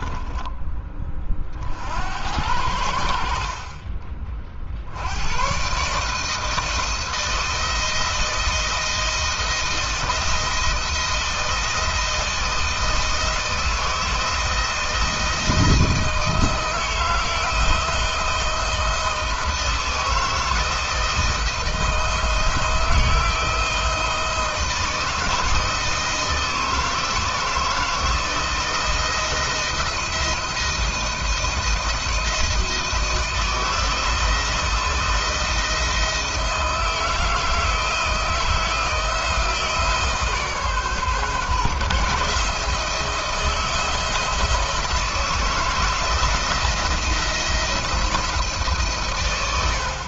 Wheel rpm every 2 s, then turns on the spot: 10, 70, 40, 160, 160, 170, 160, 170, 160, 160, 160, 170, 160, 160, 160, 170, 160, 160, 160, 160, 150, 160, 160, 170, 160.
none